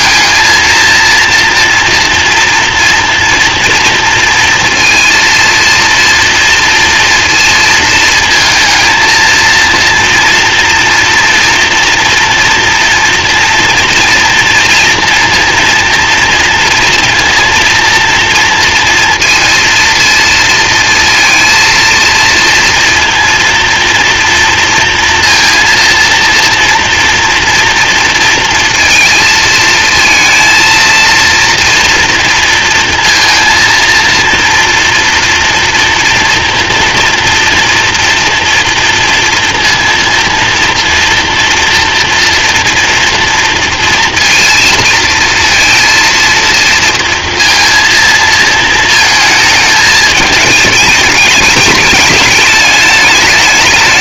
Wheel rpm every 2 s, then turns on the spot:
230, 240, 230, 230, 230, 230, 240, 240, 230, 230, 230, 230, 230, 230, 230, 230, 230, 230, 230, 230, 230, 230, 230, 230, 220, 220, 210.
none